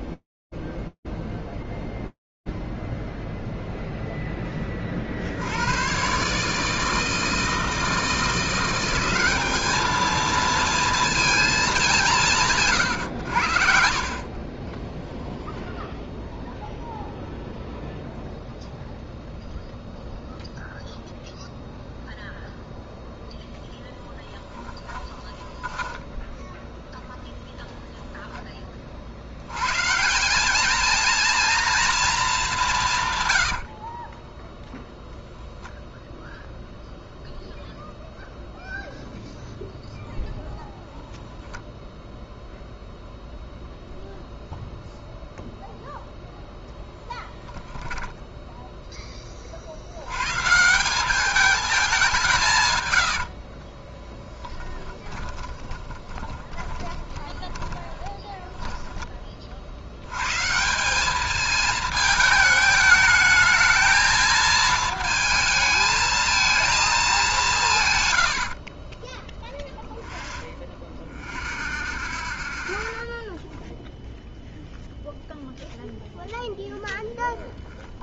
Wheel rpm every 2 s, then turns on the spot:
0, 30, 160, 190, 230, 120, 10, 0, 0, 0, 0, 0, 10, 0, 150, 230, 60, 0, 0, 0, 0, 0, 0, 10, 40, 210, 30, 20, 20, 50, 220, 220, 220, 180, 0, 0, 0, 0, 0.
10-14 24-26 32-34 52-58